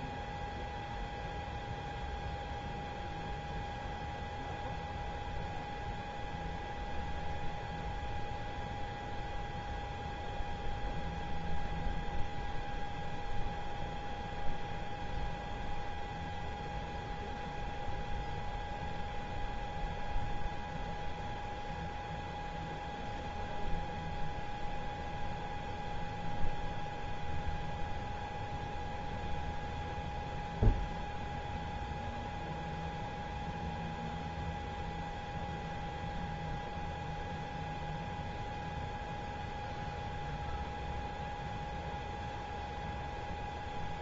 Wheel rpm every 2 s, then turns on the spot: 0, 0, 0, 0, 0, 0, 0, 0, 0, 0, 0, 0, 0, 0, 0, 0, 0, 0, 0, 0, 0, 0.
none